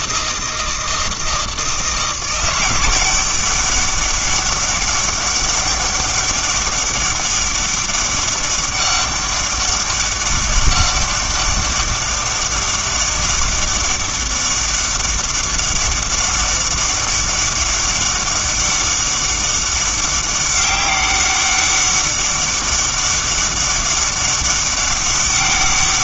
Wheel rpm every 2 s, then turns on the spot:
160, 190, 200, 200, 200, 200, 200, 200, 200, 200, 200, 200, 200.
none